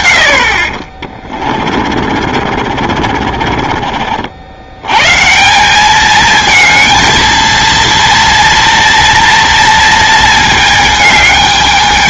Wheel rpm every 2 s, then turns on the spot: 40, 50, 130, 230, 240, 220.
2-4